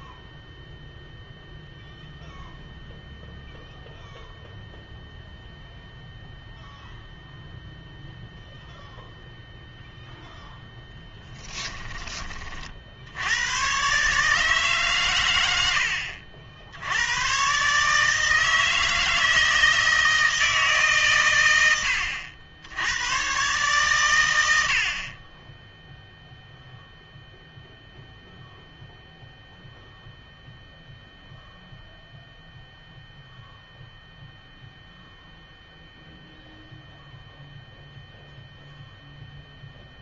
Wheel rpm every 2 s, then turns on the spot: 0, 0, 0, 0, 0, 0, 40, 150, 70, 160, 160, 100, 90, 0, 0, 0, 0, 0, 0, 0.
none